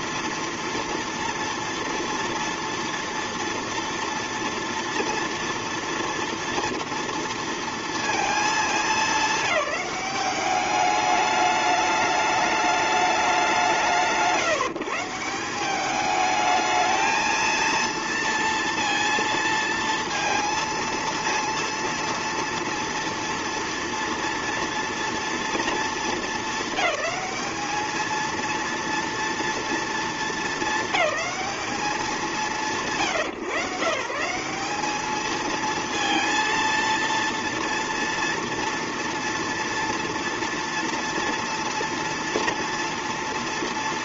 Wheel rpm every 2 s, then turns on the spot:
230, 240, 240, 230, 210, 200, 210, 160, 220, 230, 230, 230, 230, 210, 230, 220, 160, 200, 230, 240, 230, 230.
none